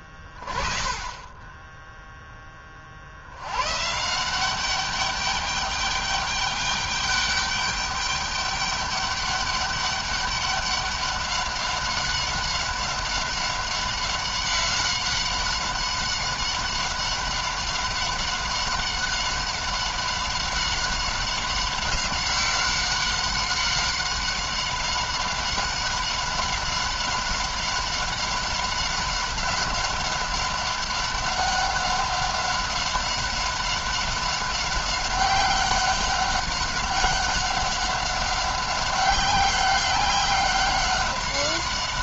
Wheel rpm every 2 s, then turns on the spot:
20, 20, 180, 200, 210, 200, 190, 190, 190, 190, 190, 190, 190, 190, 200, 200, 190, 190, 190, 190, 190.
none